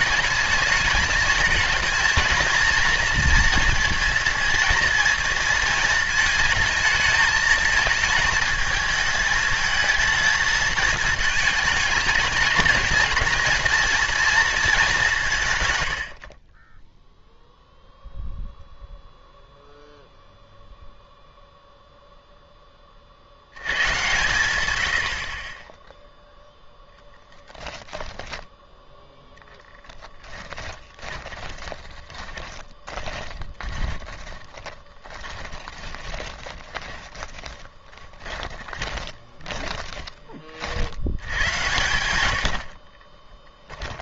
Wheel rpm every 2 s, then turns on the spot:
220, 230, 230, 220, 220, 220, 220, 190, 10, 0, 0, 20, 90, 0, 10, 20, 20, 20, 20, 30, 50, 60.
16-18 30-40 42-44